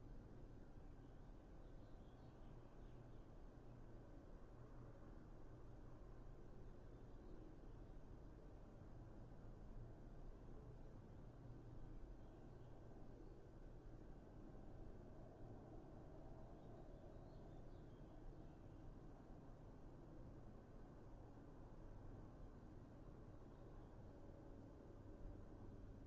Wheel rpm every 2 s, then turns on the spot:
0, 0, 0, 0, 0, 0, 0, 0, 0, 0, 0, 0, 0.
none